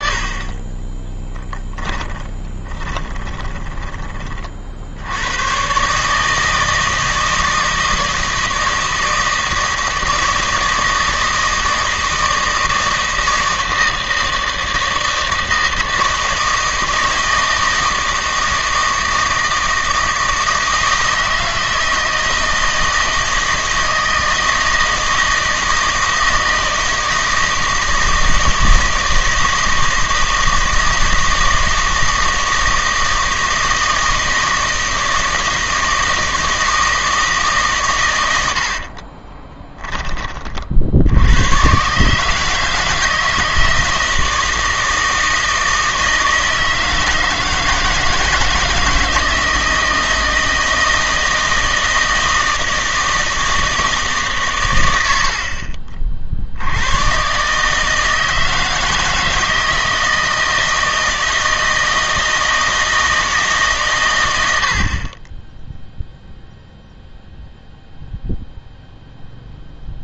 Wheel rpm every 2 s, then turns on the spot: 20, 20, 60, 160, 160, 160, 160, 160, 160, 160, 160, 160, 160, 160, 160, 160, 160, 160, 160, 70, 60, 160, 160, 160, 160, 160, 160, 100, 100, 160, 160, 160, 60, 0, 0.
0-4 38-40